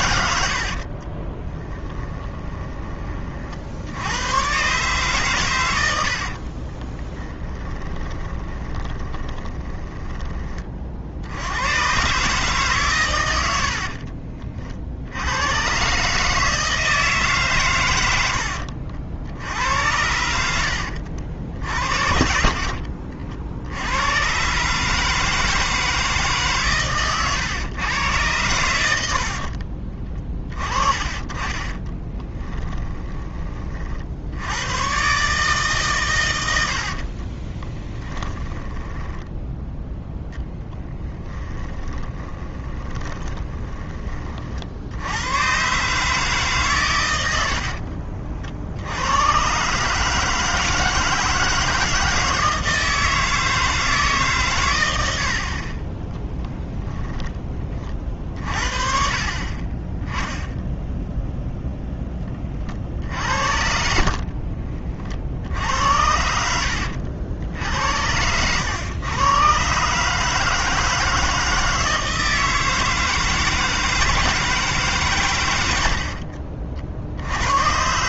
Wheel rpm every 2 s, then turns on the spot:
60, 20, 130, 40, 20, 40, 140, 50, 160, 70, 70, 60, 140, 130, 100, 30, 10, 110, 70, 10, 20, 10, 60, 130, 70, 150, 160, 110, 10, 40, 0, 40, 40, 80, 110, 160, 160, 150, 50.
0-2 6-10 22-24 30-34 36-44 66-68